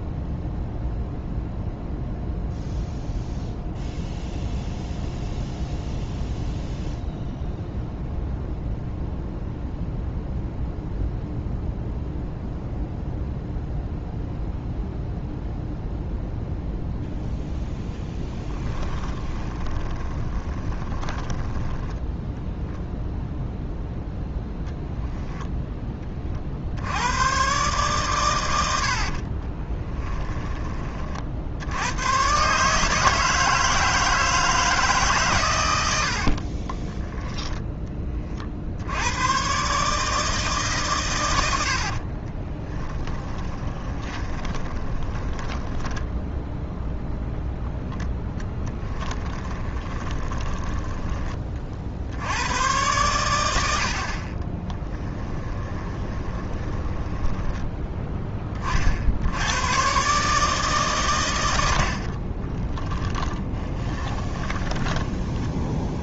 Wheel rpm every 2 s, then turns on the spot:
0, 0, 0, 0, 0, 0, 0, 0, 0, 10, 20, 0, 10, 70, 90, 20, 150, 160, 30, 70, 140, 20, 20, 0, 10, 10, 100, 20, 20, 40, 140, 20, 20.
18-22 24-26 36-38 42-46 48-52 54-58 62-66